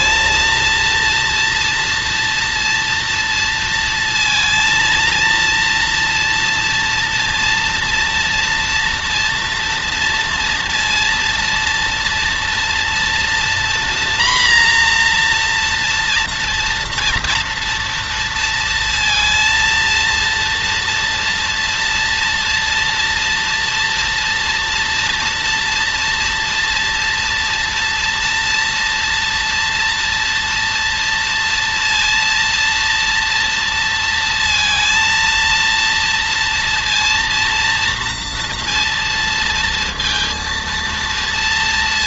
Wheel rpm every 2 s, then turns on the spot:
230, 230, 230, 230, 230, 230, 230, 240, 240, 230, 230, 230, 230, 240, 230, 230, 230, 230, 230, 230, 230.
none